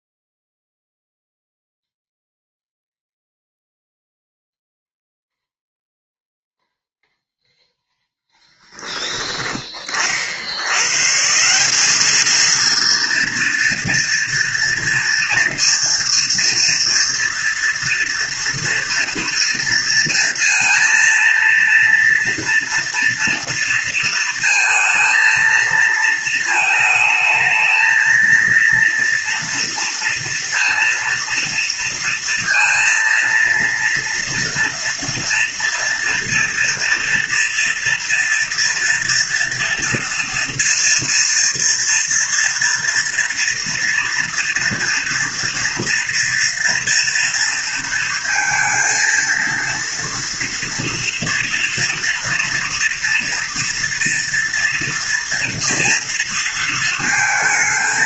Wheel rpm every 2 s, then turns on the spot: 0, 0, 0, 0, 10, 140, 230, 230, 230, 230, 230, 230, 230, 220, 230, 230, 240, 230, 230, 230, 230, 230, 230, 230, 230, 230, 230, 240, 230.
none